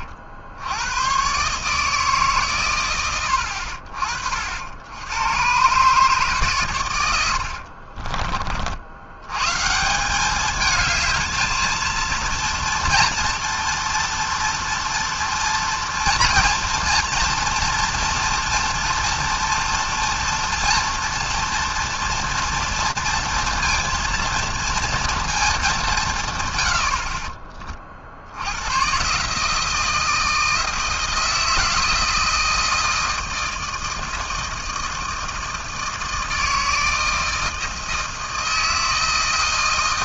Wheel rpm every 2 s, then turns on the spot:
80, 140, 60, 140, 50, 200, 230, 230, 230, 230, 230, 230, 230, 100, 90, 160, 160, 160, 160, 160.
none